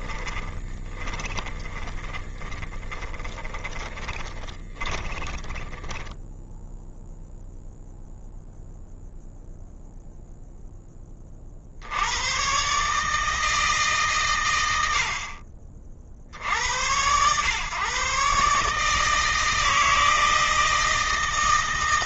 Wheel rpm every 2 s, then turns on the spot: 20, 20, 20, 0, 0, 20, 140, 100, 90, 160, 160.
0-6